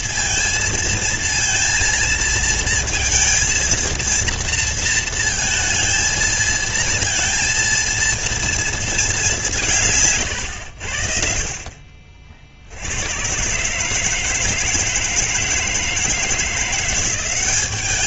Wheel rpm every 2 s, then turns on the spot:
230, 230, 230, 220, 230, 140, 40, 150, 160.
none